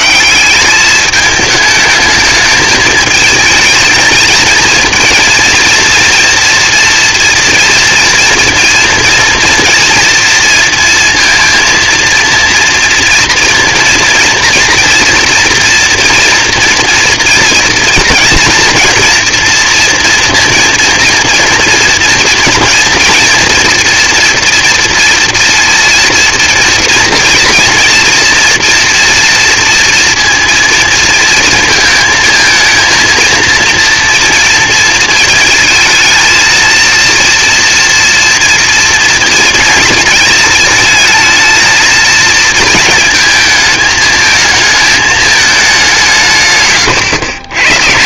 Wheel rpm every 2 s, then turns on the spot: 210, 210, 230, 230, 230, 230, 230, 230, 240, 240, 230, 230, 230, 230, 240, 230, 230, 230, 230, 230, 220, 220, 220, 130.
none